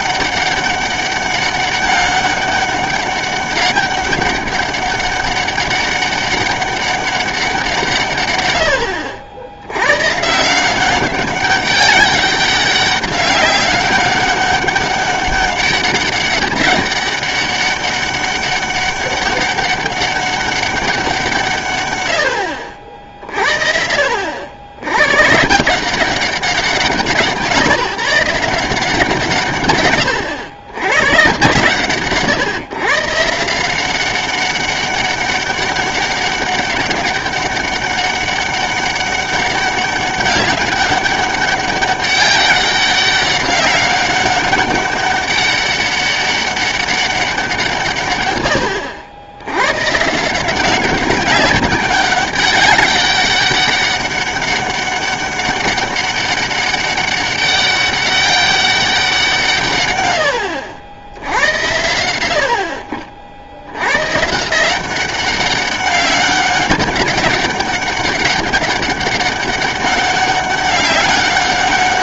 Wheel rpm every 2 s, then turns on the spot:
200, 200, 200, 200, 80, 190, 200, 200, 200, 200, 190, 60, 90, 180, 180, 120, 130, 200, 200, 190, 200, 200, 200, 200, 90, 180, 200, 200, 200, 190, 80, 60, 180, 200, 200, 200.
none